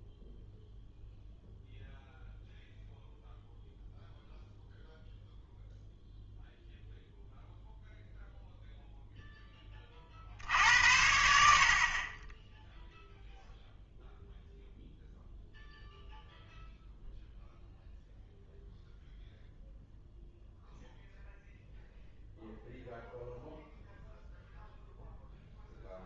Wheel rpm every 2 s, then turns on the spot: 0, 0, 0, 0, 0, 70, 0, 0, 0, 0, 0, 0, 0.
none